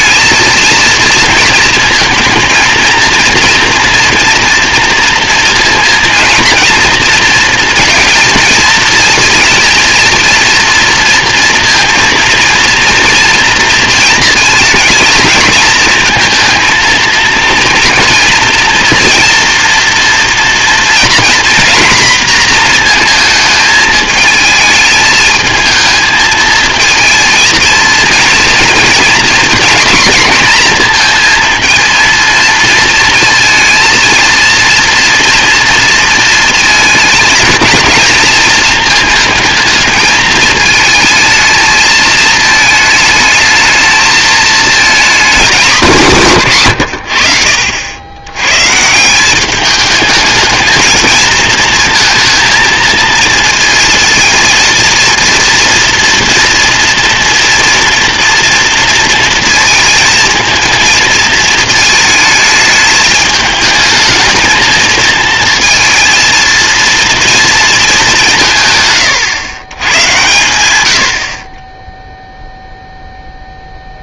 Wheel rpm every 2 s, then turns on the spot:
230, 230, 230, 230, 230, 230, 230, 230, 230, 240, 230, 230, 220, 220, 240, 240, 230, 230, 230, 220, 220, 220, 220, 150, 120, 220, 230, 230, 240, 230, 230, 220, 220, 230, 180, 100, 0.
none